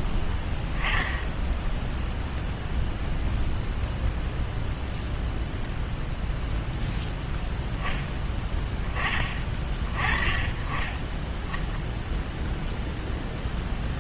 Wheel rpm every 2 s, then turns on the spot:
10, 0, 0, 0, 10, 20, 0.
none